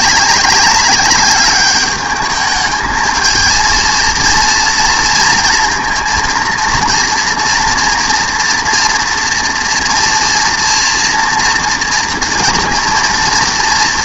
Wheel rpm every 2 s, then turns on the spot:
200, 210, 230, 230, 230, 230, 230.
none